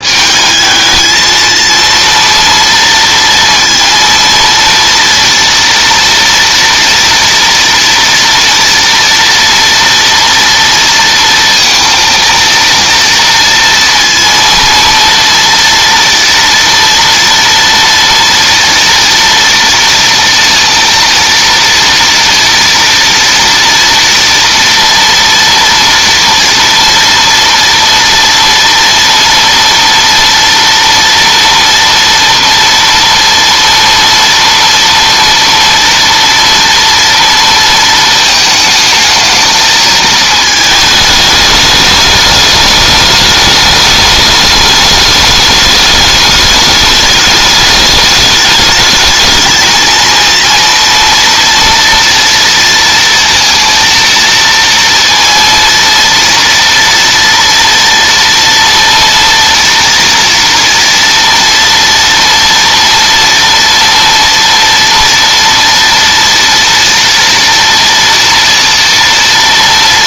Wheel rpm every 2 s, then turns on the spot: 220, 230, 230, 230, 230, 230, 230, 230, 230, 230, 230, 230, 230, 230, 230, 230, 240, 230, 230, 220, 220, 210, 210, 210, 220, 230, 230, 230, 230, 230, 230, 240, 230, 230, 230.
none